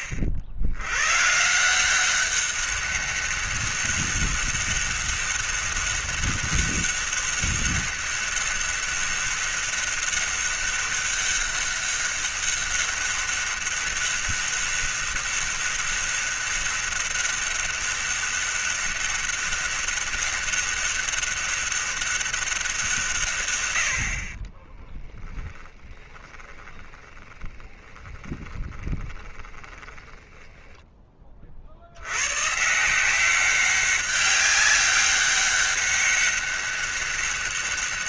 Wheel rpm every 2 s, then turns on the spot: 90, 200, 200, 200, 200, 200, 200, 200, 200, 200, 200, 180, 20, 30, 20, 10, 160, 200, 200.
24-30